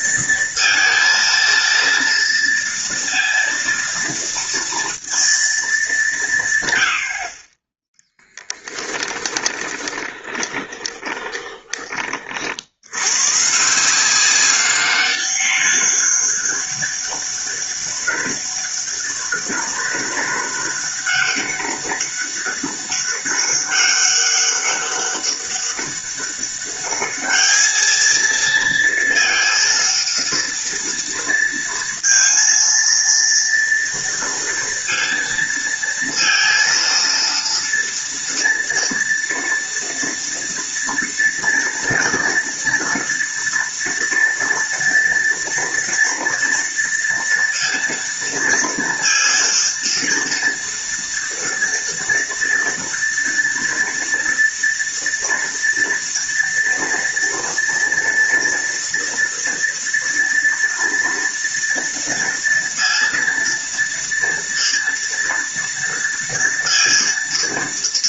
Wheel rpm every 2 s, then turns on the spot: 230, 230, 230, 100, 10, 20, 90, 200, 200, 200, 200, 200, 200, 200, 230, 230, 230, 230, 230, 230, 230, 230, 230, 230, 230, 230, 230, 230, 230, 230, 230, 230, 230, 230.
8-12